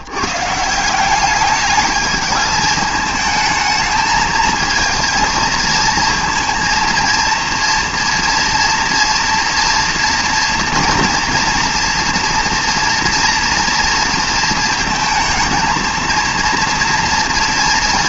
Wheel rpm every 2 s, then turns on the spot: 160, 220, 220, 230, 230, 230, 230, 230, 230.
none